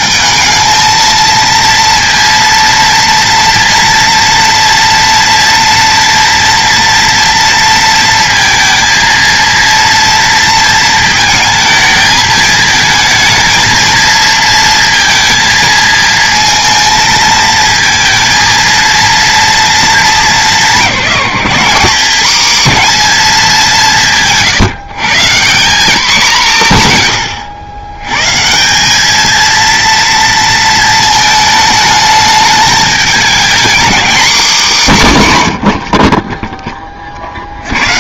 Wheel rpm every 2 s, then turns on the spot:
220, 230, 230, 230, 230, 230, 220, 230, 220, 230, 200, 230, 170, 150, 180, 230, 210, 210, 10.
none